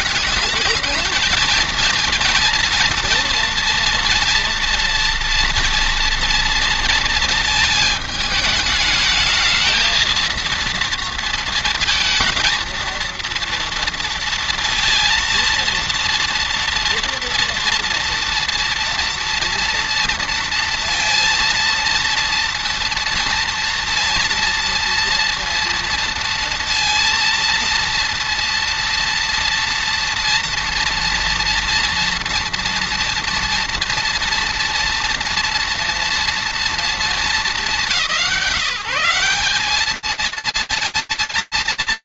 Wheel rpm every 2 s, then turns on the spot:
220, 230, 240, 230, 210, 230, 230, 230, 230, 230, 230, 230, 230, 230, 230, 230, 230, 230, 240, 180, 220.
none